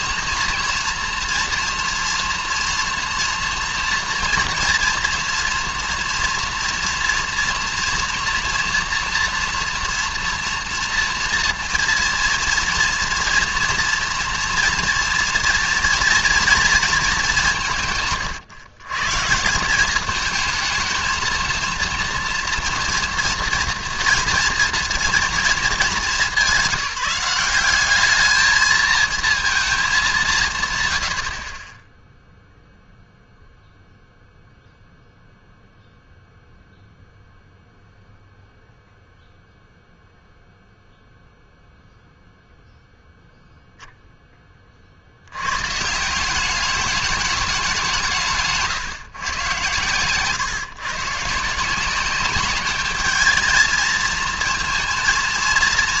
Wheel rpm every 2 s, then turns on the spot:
230, 230, 230, 230, 230, 240, 230, 230, 230, 140, 220, 230, 230, 200, 220, 140, 0, 0, 0, 0, 0, 0, 30, 200, 130, 130, 200, 230.
none